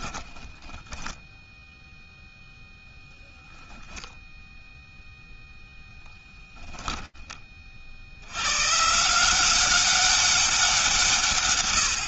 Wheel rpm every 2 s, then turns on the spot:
20, 0, 0, 10, 130, 170.
0-2